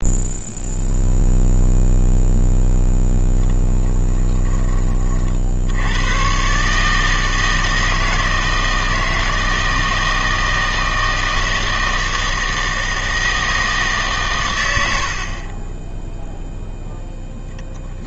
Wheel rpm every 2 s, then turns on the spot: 0, 0, 20, 140, 160, 160, 160, 110, 0.
none